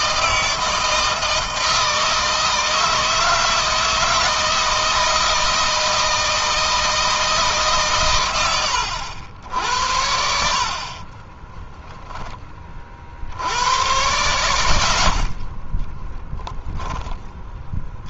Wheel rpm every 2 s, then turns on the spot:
160, 160, 160, 160, 90, 40, 30, 90, 10.
10-12